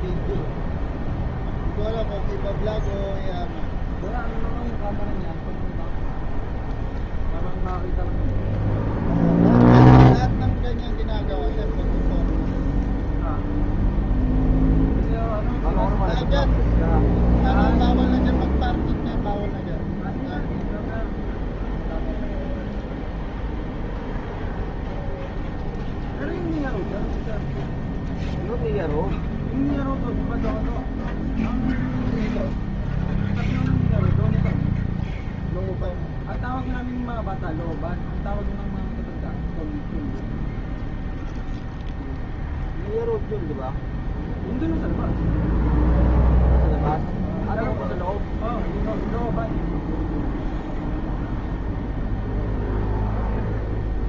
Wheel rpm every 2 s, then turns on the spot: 0, 0, 0, 0, 0, 0, 0, 0, 0, 0, 0, 0, 0, 0, 0, 0, 0, 0, 0, 0, 0, 0, 0, 0, 0, 0, 0.
none